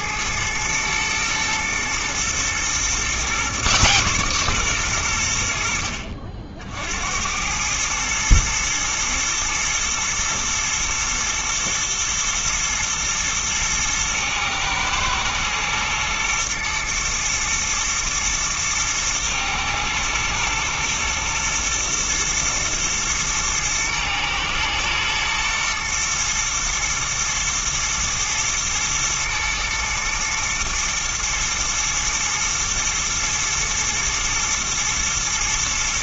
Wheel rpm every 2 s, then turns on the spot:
110, 120, 120, 60, 110, 120, 110, 110, 110, 110, 110, 120, 120, 110, 120, 120, 120, 120.
none